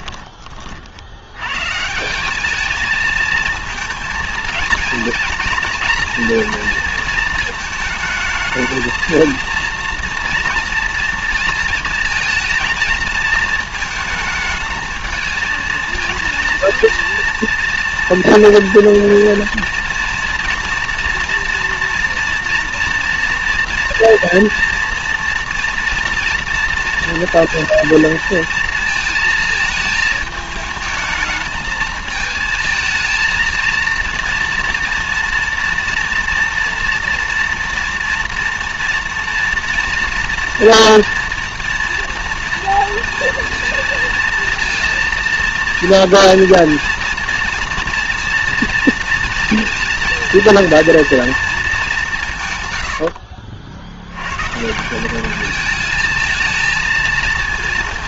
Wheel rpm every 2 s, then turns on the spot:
30, 200, 230, 230, 220, 230, 230, 220, 230, 230, 230, 230, 230, 230, 230, 220, 220, 230, 230, 230, 230, 230, 230, 230, 230, 230, 130, 140, 220.
none